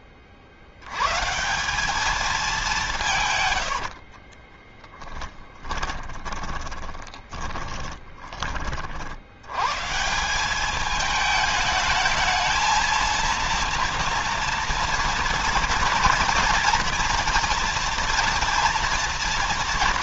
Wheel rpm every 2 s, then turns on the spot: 100, 180, 30, 20, 50, 210, 230, 230, 230, 240.
4-8